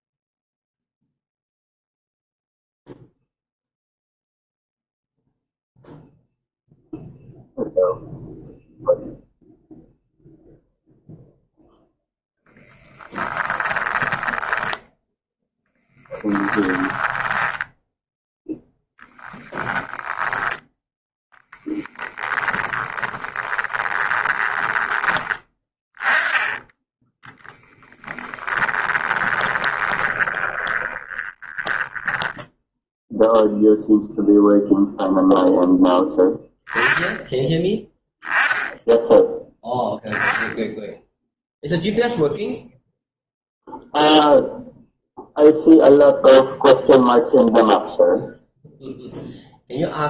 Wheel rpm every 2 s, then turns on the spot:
0, 0, 0, 0, 0, 0, 10, 10, 10, 0, 0, 10, 20, 10, 20, 10, 0, 0, 10, 10, 0, 0, 0, 0, 0.
14-18 22-24 26-32